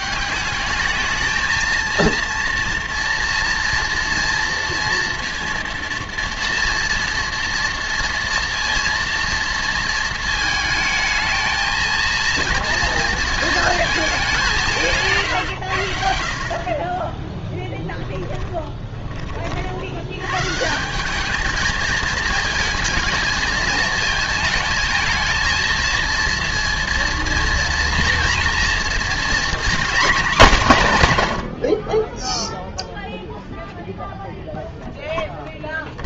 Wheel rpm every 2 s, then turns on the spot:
210, 230, 230, 230, 230, 220, 230, 160, 40, 20, 170, 220, 220, 230, 230, 180, 0, 0.
18-20